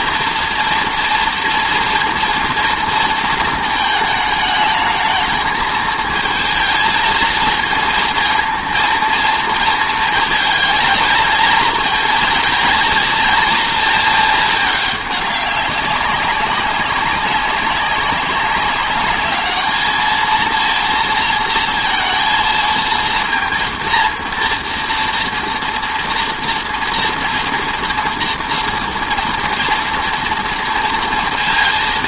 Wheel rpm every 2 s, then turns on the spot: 230, 230, 220, 230, 230, 230, 220, 210, 190, 200, 230, 230, 230, 230, 230, 230.
none